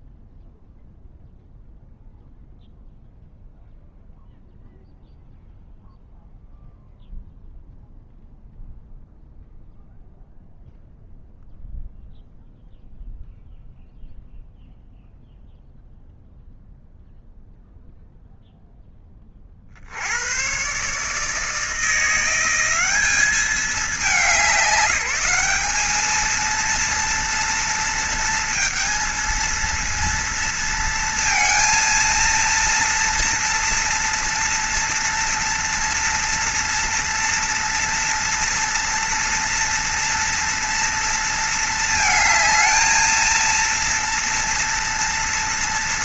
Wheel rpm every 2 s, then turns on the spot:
0, 0, 0, 0, 0, 0, 0, 0, 0, 0, 140, 190, 180, 230, 230, 230, 230, 230, 230, 230, 240, 220, 230.
none